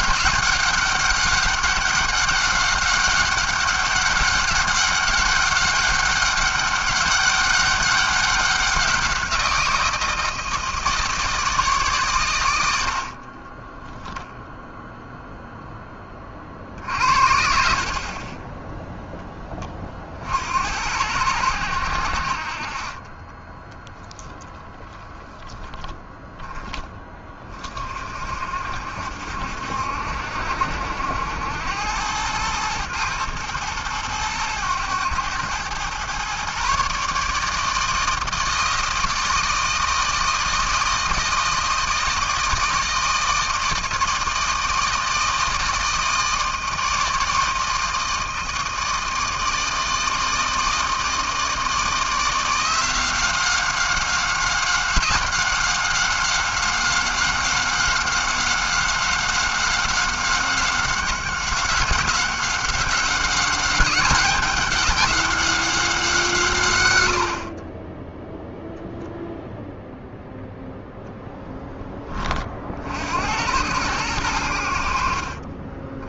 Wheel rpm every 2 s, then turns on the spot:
200, 190, 200, 200, 190, 160, 80, 0, 50, 10, 80, 40, 10, 10, 60, 70, 110, 110, 140, 160, 160, 160, 160, 160, 160, 160, 180, 190, 190, 190, 190, 190, 200, 120, 0, 0, 40, 80.
none